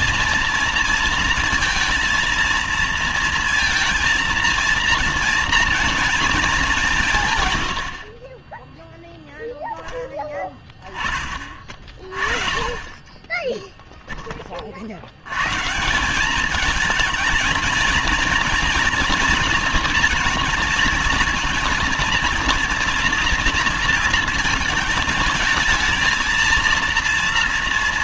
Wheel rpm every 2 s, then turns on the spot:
230, 230, 230, 200, 10, 20, 30, 40, 220, 230, 220, 230, 220, 230.
none